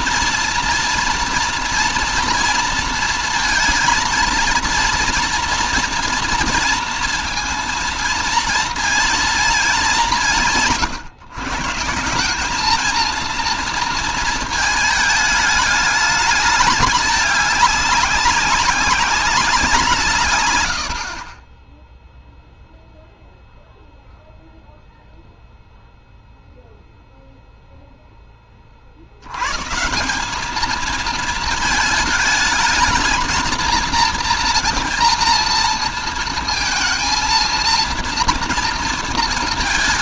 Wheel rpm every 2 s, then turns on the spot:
230, 230, 230, 230, 230, 160, 210, 220, 220, 200, 100, 0, 0, 0, 40, 220, 220, 230, 230, 230.
none